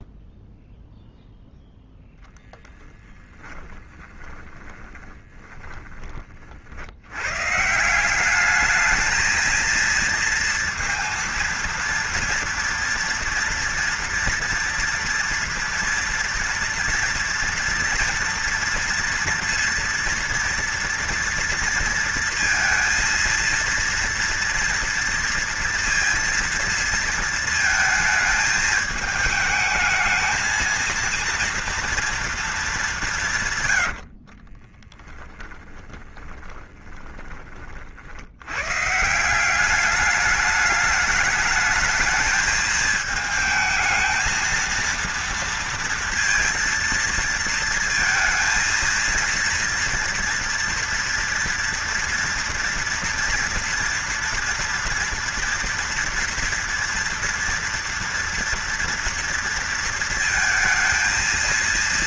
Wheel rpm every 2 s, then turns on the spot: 0, 20, 20, 70, 210, 230, 230, 230, 230, 230, 230, 230, 230, 230, 220, 220, 200, 20, 20, 150, 210, 220, 230, 230, 230, 230, 230, 230, 240, 230, 230.
2-6 34-38